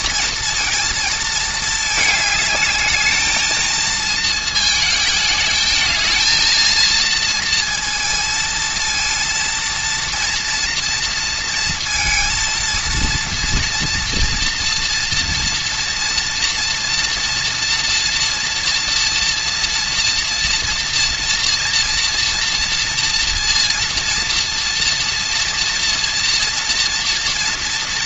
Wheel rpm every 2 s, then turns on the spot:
230, 210, 220, 230, 230, 230, 230, 230, 230, 230, 230, 230, 230, 230.
none